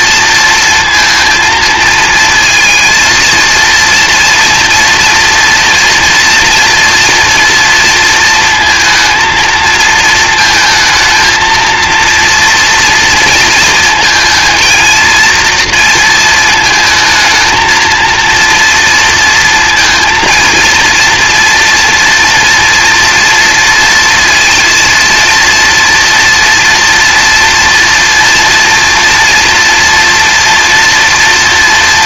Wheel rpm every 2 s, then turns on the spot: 230, 220, 230, 230, 230, 220, 230, 230, 220, 230, 230, 230, 230, 230, 230, 230.
none